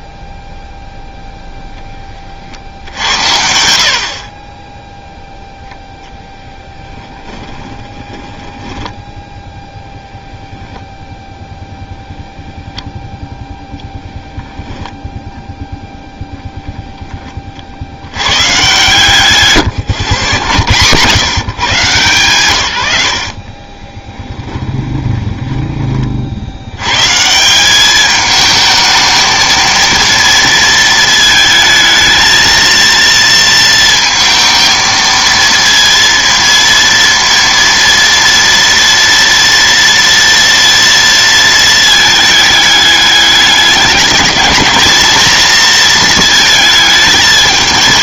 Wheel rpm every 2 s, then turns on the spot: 0, 70, 20, 10, 10, 0, 0, 0, 0, 150, 110, 120, 10, 100, 220, 230, 230, 230, 230, 230, 230, 210, 220, 220.
6-10 22-26